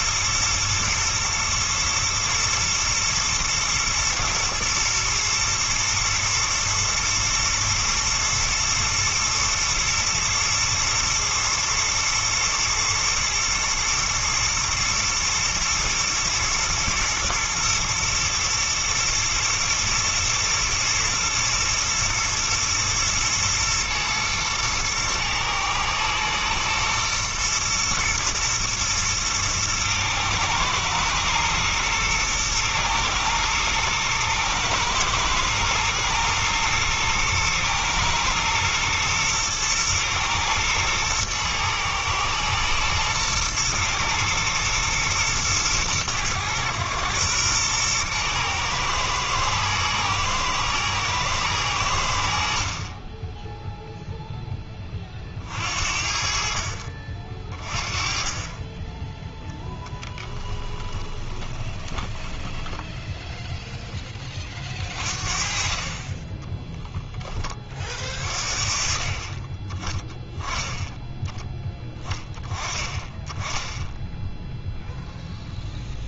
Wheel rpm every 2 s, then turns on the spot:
120, 110, 110, 120, 110, 110, 110, 120, 120, 110, 120, 120, 110, 110, 110, 110, 110, 110, 110, 120, 110, 110, 110, 110, 110, 120, 50, 10, 50, 20, 10, 10, 40, 10, 40, 10, 20, 0.
60-64 66-68